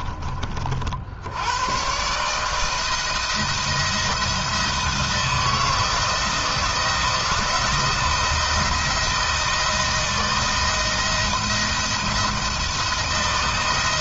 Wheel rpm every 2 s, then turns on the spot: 60, 160, 160, 170, 170, 170, 170.
none